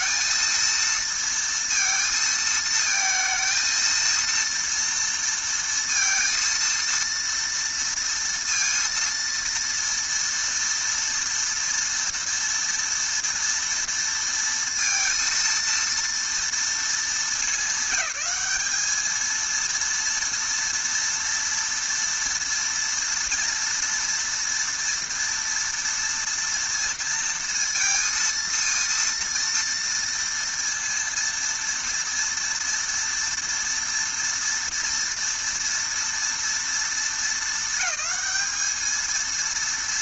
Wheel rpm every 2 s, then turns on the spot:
230, 220, 230, 230, 230, 230, 230, 230, 230, 210, 230, 230, 230, 230, 230, 230, 230, 230, 230, 210.
none